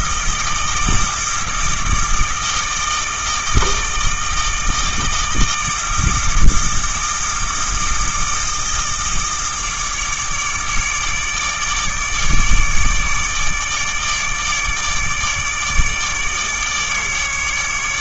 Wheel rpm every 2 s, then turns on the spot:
160, 160, 160, 160, 160, 150, 150, 150, 150.
none